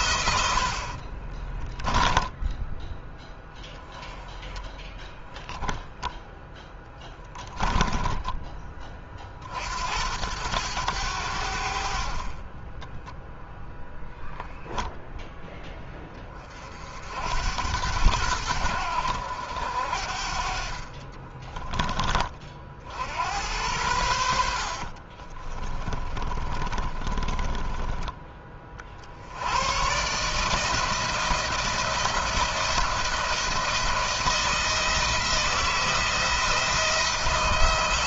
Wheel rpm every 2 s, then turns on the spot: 70, 10, 10, 10, 30, 100, 20, 0, 40, 90, 40, 60, 70, 30, 40, 160, 170, 170, 170.
0-2 6-8 12-14 20-22 24-28